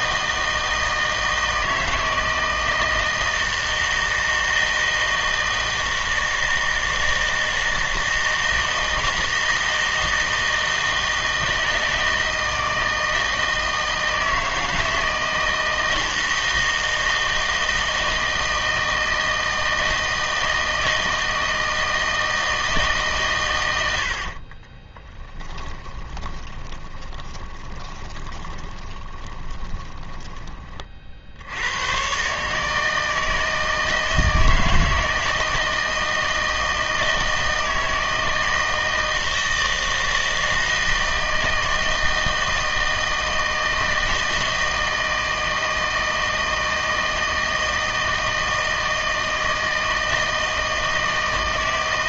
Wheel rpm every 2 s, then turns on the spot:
160, 160, 160, 160, 160, 160, 160, 160, 160, 160, 160, 160, 30, 20, 20, 30, 150, 160, 160, 160, 160, 160, 160, 160, 160, 160.
24-30